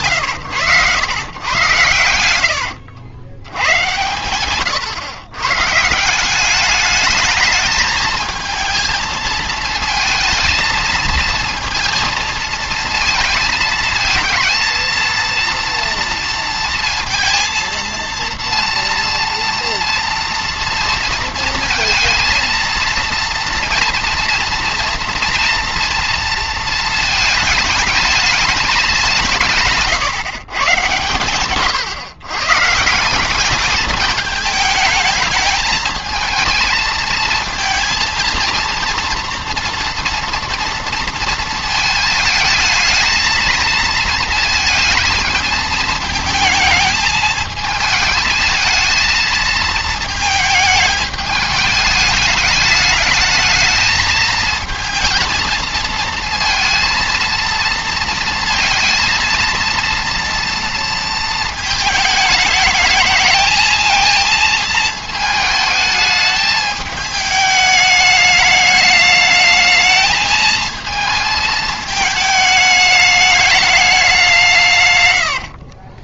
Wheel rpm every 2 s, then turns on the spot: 110, 80, 120, 200, 220, 230, 220, 230, 230, 230, 230, 230, 230, 220, 210, 130, 150, 210, 220, 230, 230, 220, 220, 220, 220, 220, 210, 220, 230, 230, 230, 210, 220, 210, 210, 220, 220, 140.
2-4 74-76